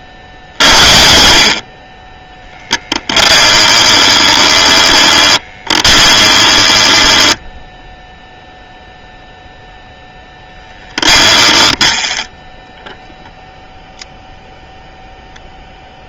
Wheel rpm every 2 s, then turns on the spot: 60, 10, 20, 20, 0, 10, 0, 0.
2-8 10-12